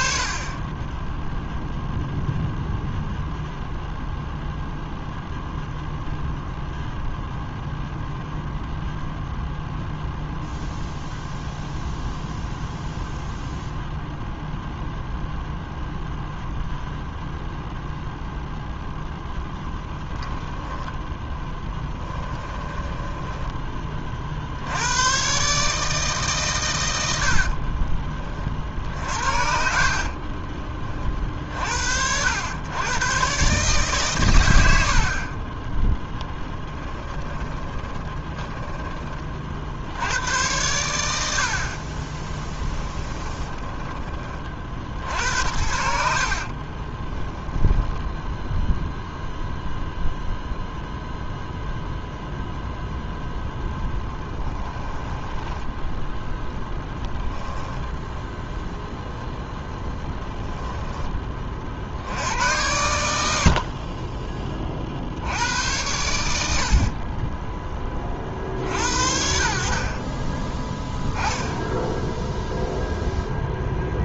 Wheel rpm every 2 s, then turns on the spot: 10, 0, 0, 0, 0, 0, 0, 0, 0, 0, 10, 10, 90, 100, 50, 30, 100, 80, 20, 20, 90, 20, 60, 30, 0, 0, 0, 10, 0, 0, 10, 110, 50, 60, 60, 10, 0.
20-24 28-30 36-40 42-44 46-48 54-56 66-68